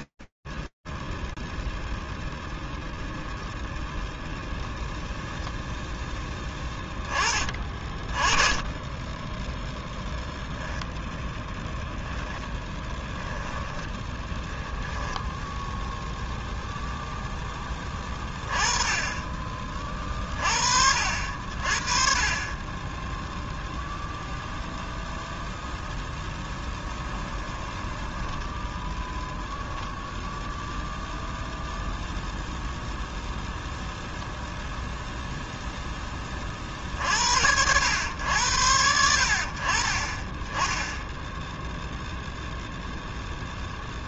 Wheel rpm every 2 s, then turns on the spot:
0, 0, 20, 0, 0, 10, 10, 0, 20, 40, 30, 0, 10, 10, 0, 0, 10, 20, 90, 20, 0, 0.
10-12 26-28